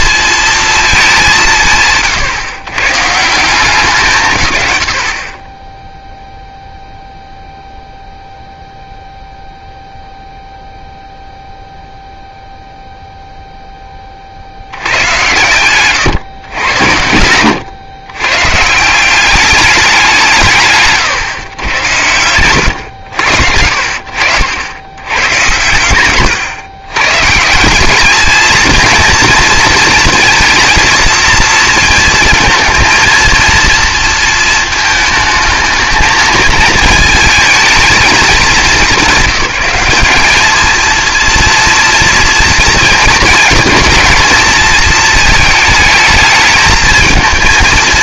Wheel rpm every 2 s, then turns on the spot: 230, 120, 120, 0, 0, 0, 0, 80, 100, 140, 160, 110, 100, 110, 220, 230, 220, 220, 220, 210, 220, 230, 220, 220.
none